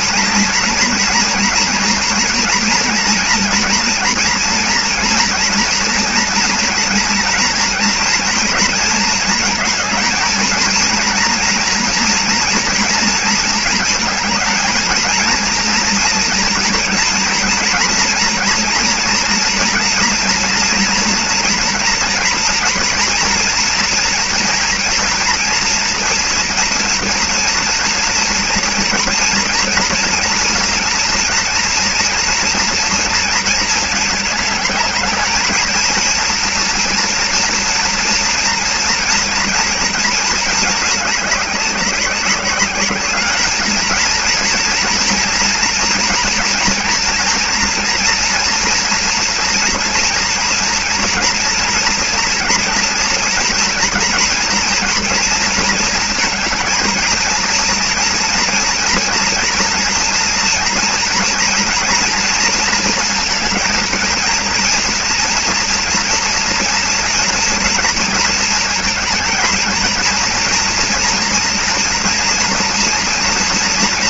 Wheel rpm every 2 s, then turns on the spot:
240, 230, 240, 230, 230, 230, 240, 220, 230, 230, 230, 230, 230, 230, 240, 230, 230, 210, 230, 230, 220, 200, 240, 230, 230, 230, 230, 230, 220, 230, 230, 230, 230, 230, 230, 230, 240.
none